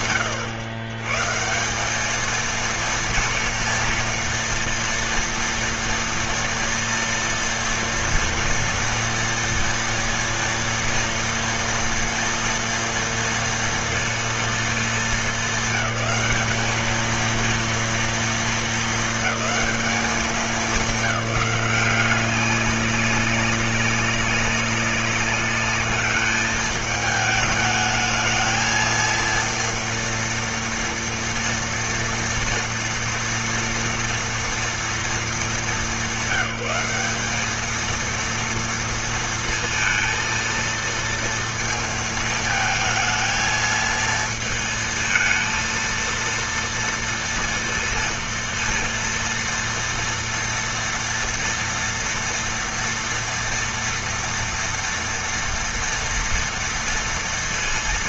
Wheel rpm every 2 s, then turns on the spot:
120, 230, 230, 230, 230, 230, 230, 210, 230, 220, 180, 200, 200, 210, 230, 230, 230, 220, 210, 230, 230, 220, 220, 230, 230, 230, 240, 240, 230.
none